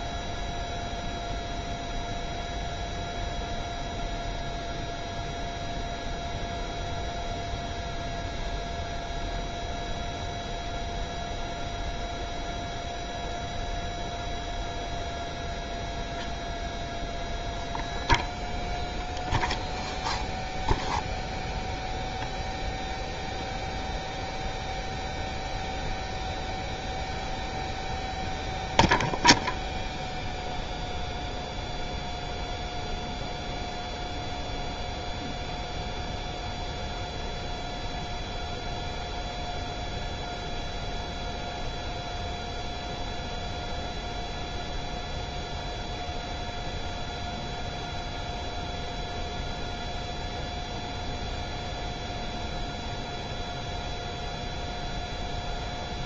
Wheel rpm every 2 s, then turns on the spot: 0, 0, 0, 0, 0, 0, 0, 0, 0, 0, 0, 0, 0, 0, 0, 0, 0, 0, 0, 0, 0, 0, 0, 0, 0, 0, 0, 0.
none